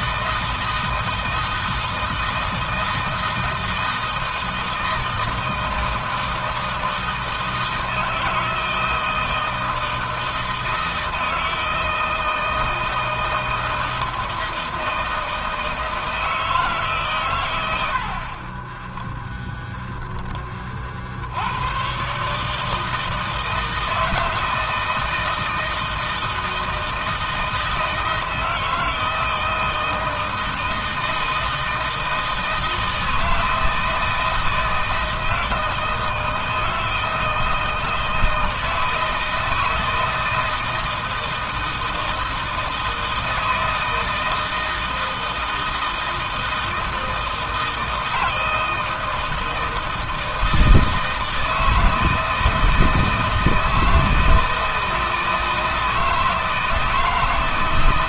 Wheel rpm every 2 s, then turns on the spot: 160, 160, 160, 160, 160, 160, 160, 160, 130, 20, 40, 160, 160, 160, 160, 160, 160, 160, 160, 160, 160, 160, 160, 160, 160, 160, 160, 160, 160.
none